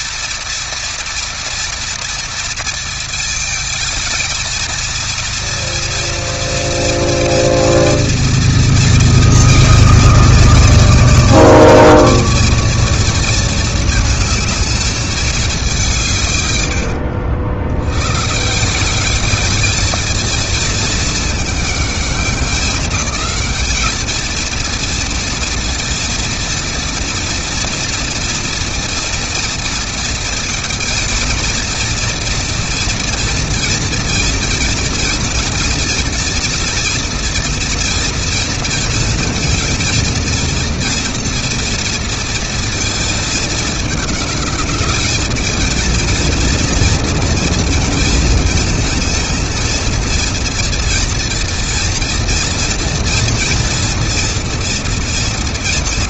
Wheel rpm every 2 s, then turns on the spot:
230, 220, 230, 230, 220, 220, 230, 210, 80, 200, 220, 200, 230, 230, 230, 230, 230, 230, 230, 230, 230, 220, 210, 230, 230, 230, 230, 230.
none